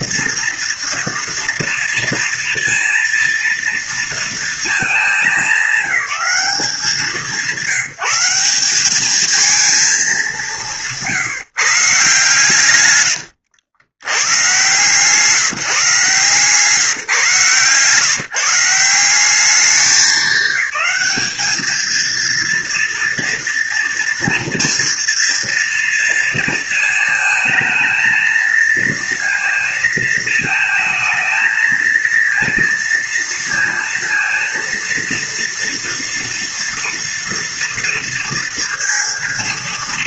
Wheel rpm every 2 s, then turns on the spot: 230, 230, 220, 190, 190, 170, 140, 120, 140, 160, 200, 230, 230, 230, 230, 220, 230, 230, 230, 230.
none